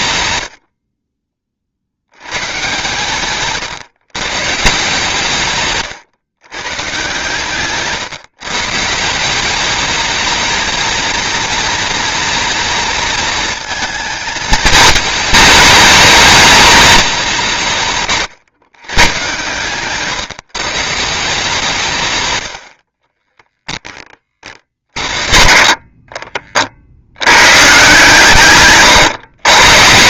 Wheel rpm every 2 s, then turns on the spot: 90, 130, 150, 130, 140, 220, 230, 210, 210, 140, 130, 80, 50, 40, 130.
none